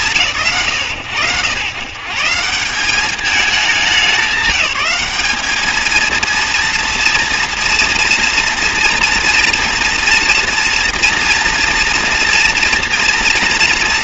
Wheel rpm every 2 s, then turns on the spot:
110, 170, 200, 230, 230, 240, 230.
none